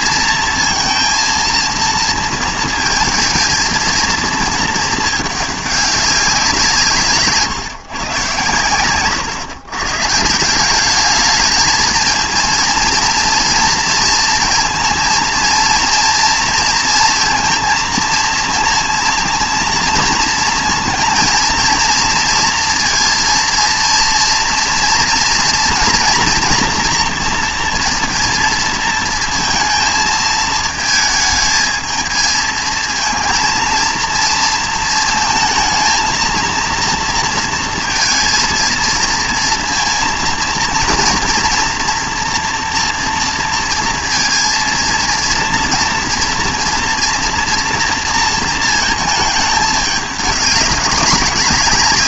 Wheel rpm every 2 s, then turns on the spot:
230, 230, 220, 170, 110, 180, 230, 230, 230, 230, 230, 230, 230, 240, 230, 220, 220, 230, 230, 230, 230, 240, 230, 230, 220, 200.
none